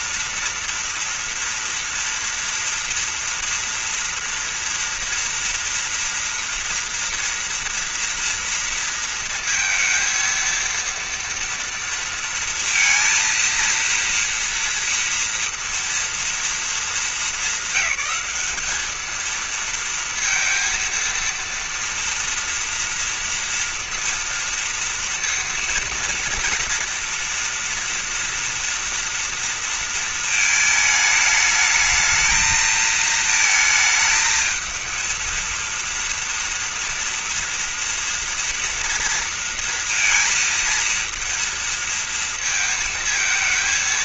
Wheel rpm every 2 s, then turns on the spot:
240, 230, 230, 240, 230, 230, 230, 230, 230, 200, 230, 230, 230, 230, 230, 220, 220, 220, 230, 230, 230, 230.
none